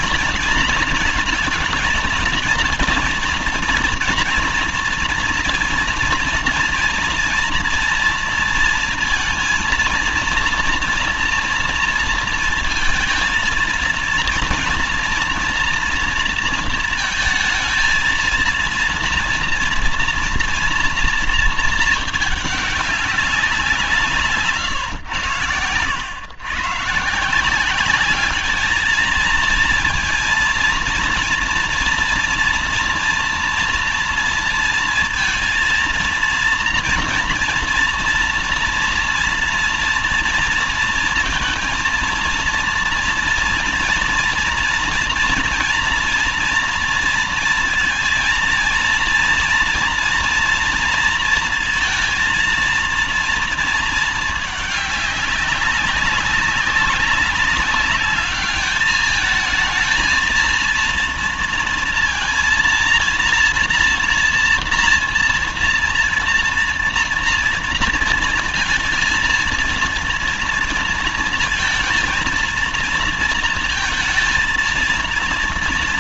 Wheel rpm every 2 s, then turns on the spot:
230, 230, 230, 230, 230, 230, 230, 230, 230, 230, 230, 200, 150, 120, 220, 230, 240, 230, 230, 230, 230, 230, 230, 230, 230, 230, 230, 220, 200, 210, 230, 230, 230, 230, 230, 230, 230, 230.
none